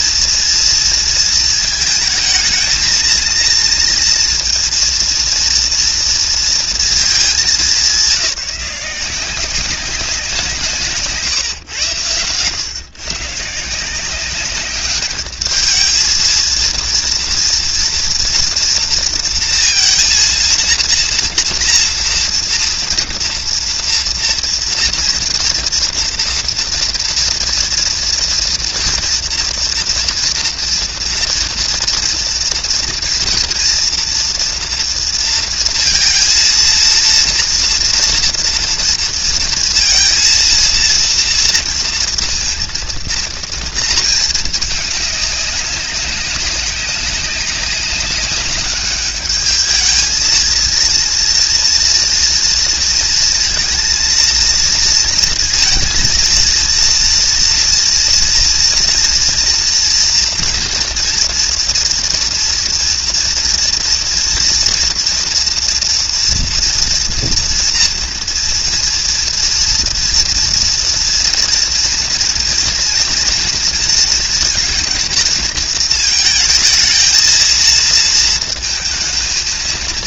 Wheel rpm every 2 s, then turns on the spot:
230, 230, 230, 220, 180, 170, 130, 200, 230, 230, 230, 230, 240, 230, 230, 230, 230, 230, 230, 230, 230, 230, 210, 200, 210, 220, 230, 230, 240, 230, 230, 230, 230, 230, 230, 230, 240, 240, 220, 220.
none